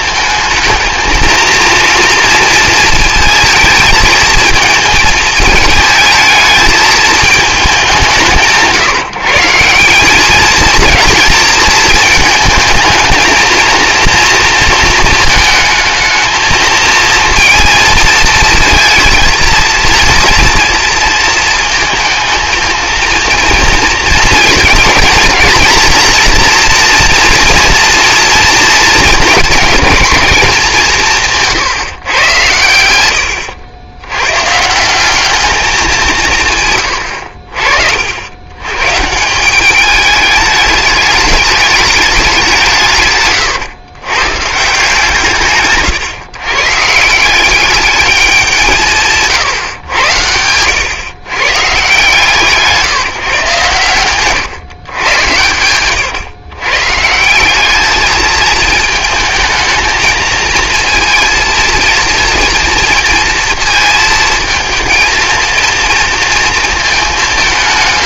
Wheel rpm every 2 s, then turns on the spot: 220, 230, 220, 220, 160, 220, 220, 230, 220, 220, 230, 220, 230, 240, 230, 190, 100, 150, 140, 120, 210, 170, 160, 150, 180, 100, 160, 130, 120, 220, 230, 230, 230, 220.
none